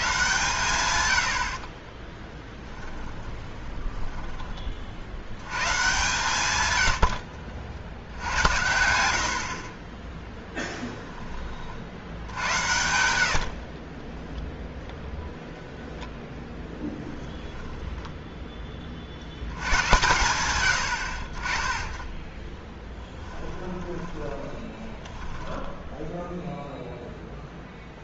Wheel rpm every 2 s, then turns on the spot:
130, 20, 40, 110, 90, 10, 70, 0, 20, 20, 80, 20, 20, 0.
2-4 10-14 16-18 22-26